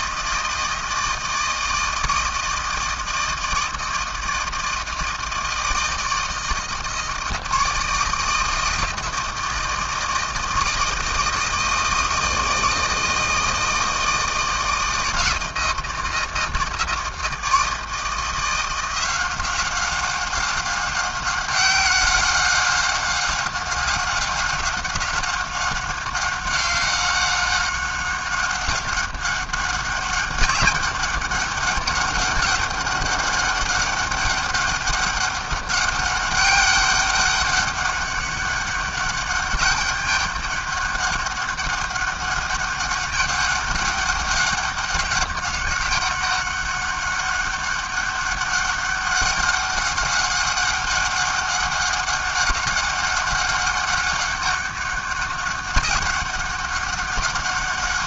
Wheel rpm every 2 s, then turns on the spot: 160, 160, 160, 160, 160, 160, 160, 160, 160, 170, 190, 190, 190, 190, 190, 200, 200, 200, 200, 200, 200, 200, 200, 200, 190, 190, 200, 200, 190.
none